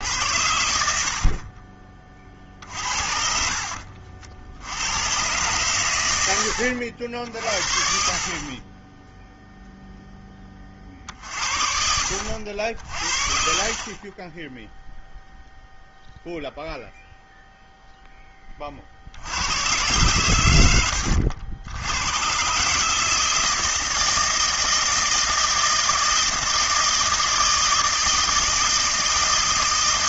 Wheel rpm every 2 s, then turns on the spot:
90, 50, 70, 90, 20, 30, 70, 10, 0, 30, 100, 130, 160, 160, 160.
2-4